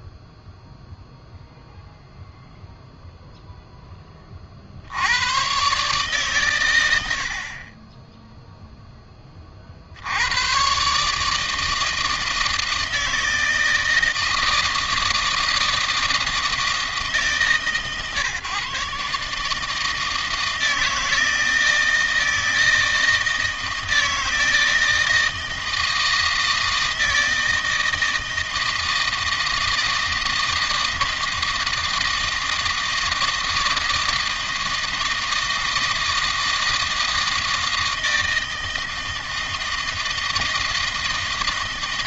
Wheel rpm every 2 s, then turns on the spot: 0, 0, 70, 90, 10, 130, 160, 160, 160, 150, 160, 160, 160, 160, 160, 160, 160, 160, 160, 160, 160.
none